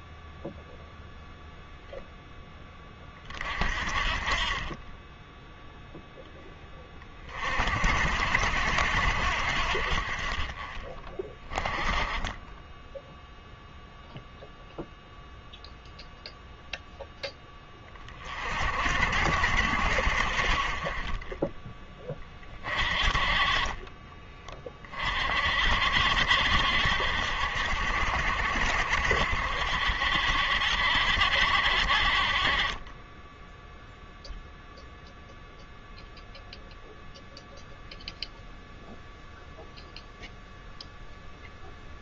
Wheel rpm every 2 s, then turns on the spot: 0, 20, 20, 20, 70, 30, 10, 0, 0, 50, 30, 40, 30, 60, 60, 60, 20, 0, 0, 0, 0.
none